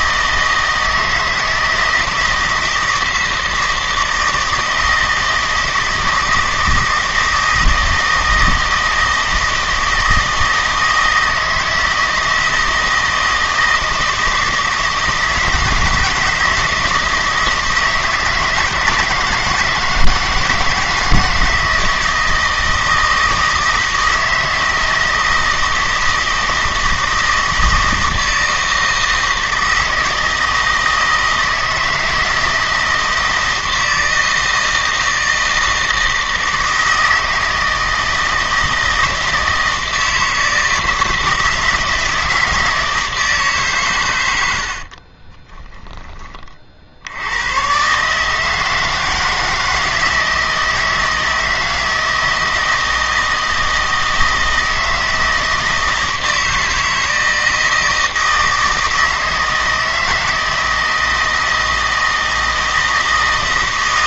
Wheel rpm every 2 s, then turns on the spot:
160, 160, 160, 160, 160, 160, 160, 160, 160, 160, 160, 160, 160, 160, 160, 160, 160, 160, 160, 160, 160, 160, 70, 50, 160, 160, 160, 160, 160, 160, 160, 160.
44-46